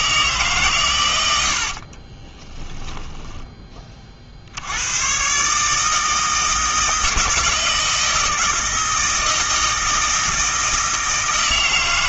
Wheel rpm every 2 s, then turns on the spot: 130, 10, 80, 160, 160, 160.
2-4